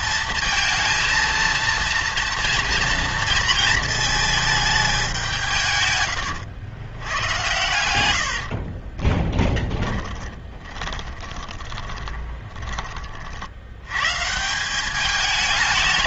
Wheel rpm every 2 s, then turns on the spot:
230, 230, 210, 100, 50, 20, 20, 170.
8-12